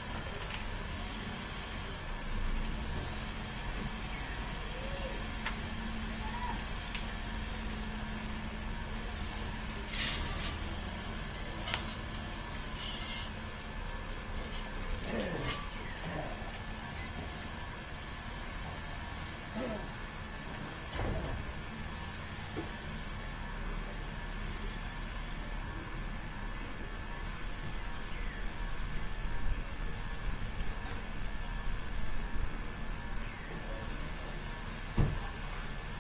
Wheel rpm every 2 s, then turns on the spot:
0, 0, 0, 0, 0, 0, 0, 0, 0, 0, 0, 0, 0, 0, 0, 0, 0, 0.
none